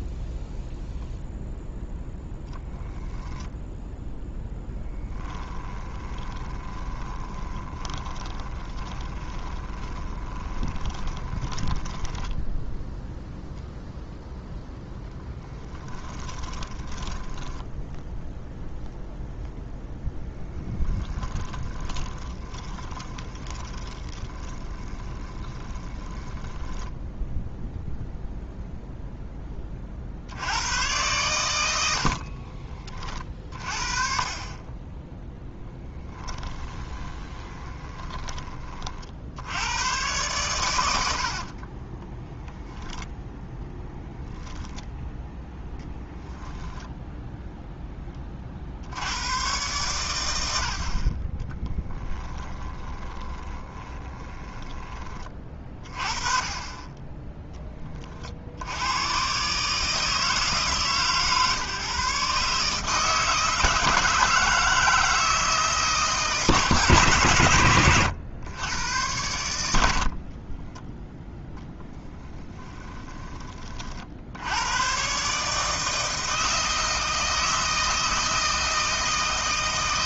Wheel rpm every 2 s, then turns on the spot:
0, 10, 10, 20, 20, 20, 0, 0, 20, 0, 10, 20, 20, 10, 0, 100, 30, 20, 20, 40, 90, 0, 0, 0, 60, 60, 30, 20, 20, 90, 140, 150, 160, 150, 100, 10, 10, 110, 160, 160.
4-12 16-18 20-28 36-38 52-54 72-74